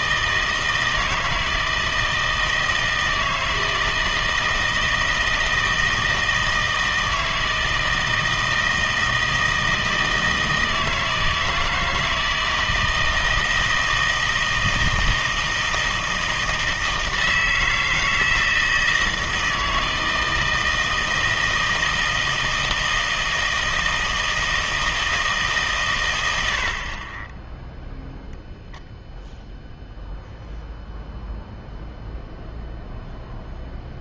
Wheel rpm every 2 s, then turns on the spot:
160, 160, 160, 160, 160, 160, 160, 160, 160, 160, 160, 160, 160, 60, 0, 0, 0.
none